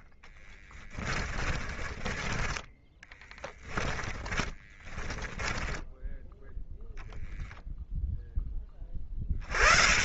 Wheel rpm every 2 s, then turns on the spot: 20, 10, 20, 0, 0.
0-2 4-6